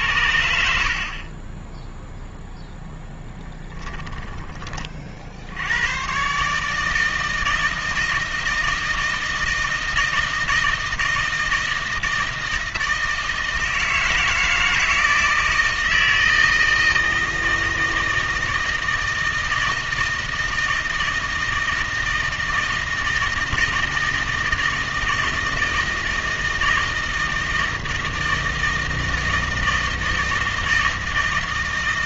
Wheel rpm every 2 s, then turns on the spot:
80, 0, 30, 150, 160, 160, 160, 160, 160, 160, 160, 160, 160, 160, 160, 160.
none